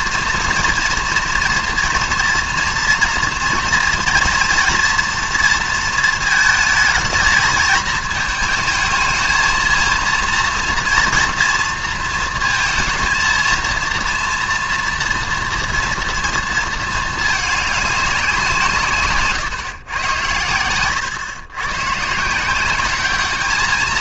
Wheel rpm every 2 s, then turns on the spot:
230, 230, 230, 220, 220, 230, 230, 230, 230, 180, 110, 170.
none